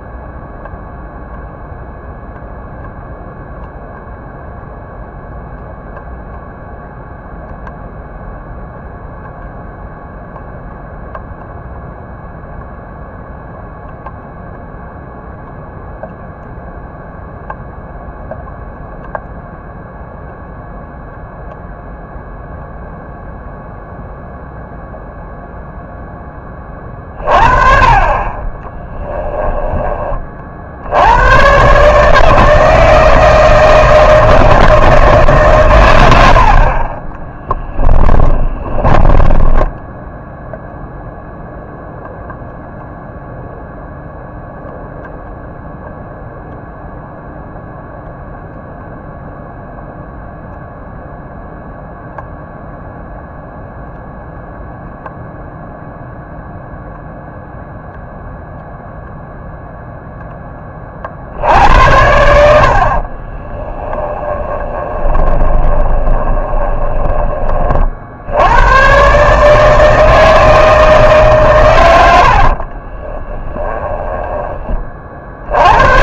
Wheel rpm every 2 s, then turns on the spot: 0, 0, 0, 0, 0, 0, 0, 0, 0, 0, 0, 0, 0, 30, 20, 60, 160, 160, 40, 20, 0, 0, 0, 0, 0, 0, 0, 0, 0, 0, 30, 50, 20, 20, 110, 160, 50, 20.
28-30 36-40 64-68 72-74